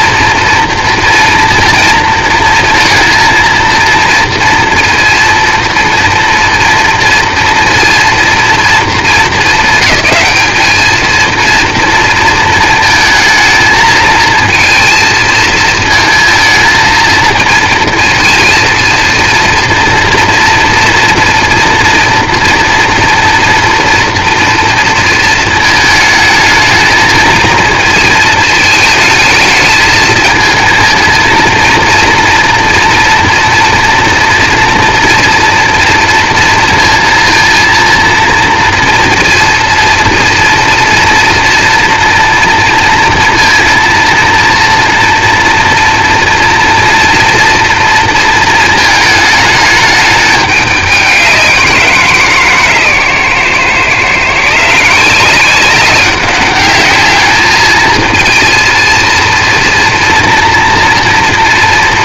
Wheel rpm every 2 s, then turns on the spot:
230, 230, 240, 230, 220, 220, 230, 230, 230, 240, 230, 230, 230, 220, 220, 220, 230, 230, 230, 230, 230, 230, 230, 230, 220, 200, 140, 170, 210, 230, 230.
none